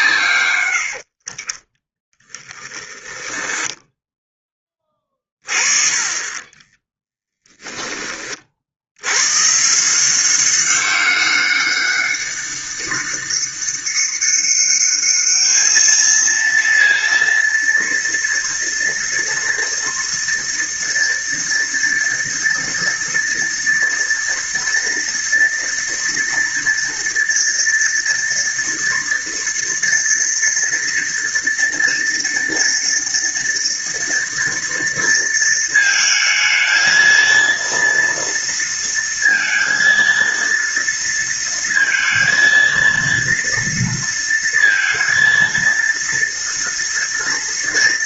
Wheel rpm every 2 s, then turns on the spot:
80, 20, 20, 10, 70, 190, 200, 200, 230, 230, 230, 230, 230, 230, 230, 230, 230, 230, 230, 230, 230, 230, 230, 230.
2-4 6-8